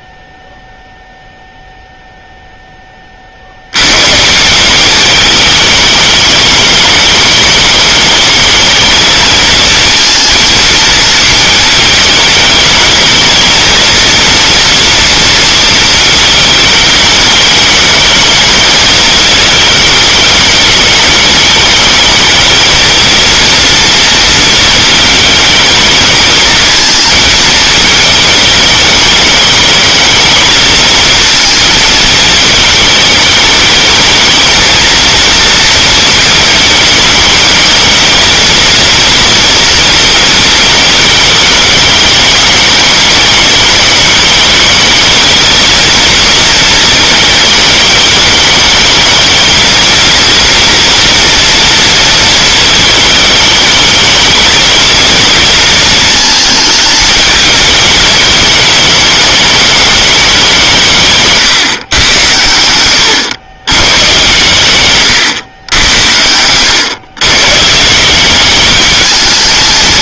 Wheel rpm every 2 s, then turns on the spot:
0, 10, 170, 220, 210, 220, 220, 230, 220, 210, 210, 220, 230, 220, 210, 230, 220, 220, 220, 230, 220, 210, 220, 220, 210, 230, 220, 220, 220, 210, 190, 100, 120, 100, 200.
none